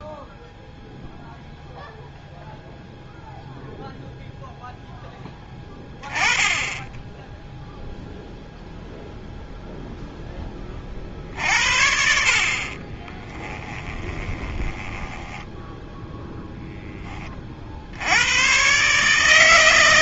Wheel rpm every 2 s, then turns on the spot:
0, 0, 0, 10, 0, 30, 40, 10, 10, 140.
12-16